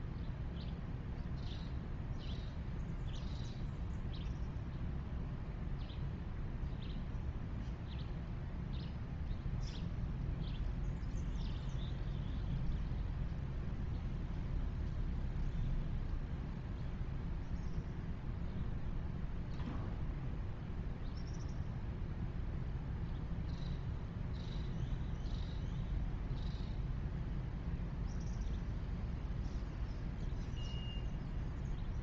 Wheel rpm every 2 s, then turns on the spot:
0, 0, 0, 0, 0, 0, 0, 0, 0, 0, 0, 0, 0, 0, 0, 0.
none